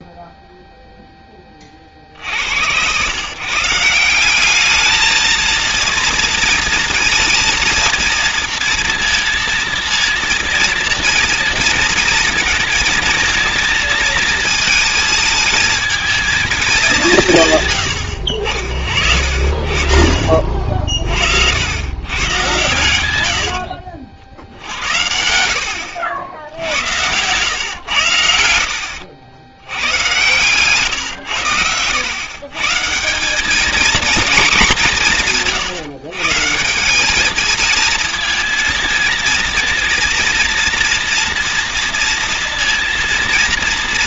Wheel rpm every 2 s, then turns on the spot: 0, 110, 210, 230, 230, 230, 220, 220, 190, 60, 50, 110, 90, 90, 80, 130, 160, 190, 180, 230, 230, 240.
18-22 26-32